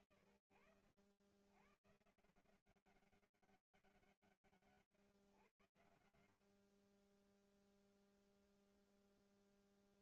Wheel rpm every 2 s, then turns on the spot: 180, 100, 0, 0, 160.
none